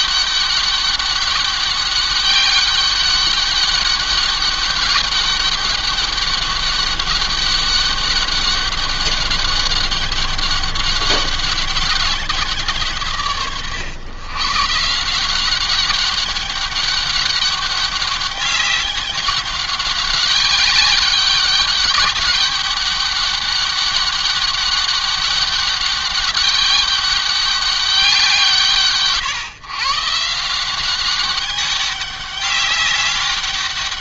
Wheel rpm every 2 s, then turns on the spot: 200, 200, 200, 200, 200, 200, 140, 190, 200, 200, 200, 200, 200, 200, 130, 200, 200.
none